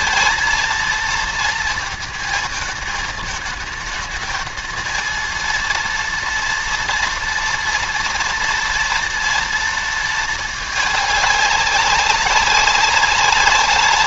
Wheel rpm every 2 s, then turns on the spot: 230, 220, 230, 230, 230, 210, 200.
none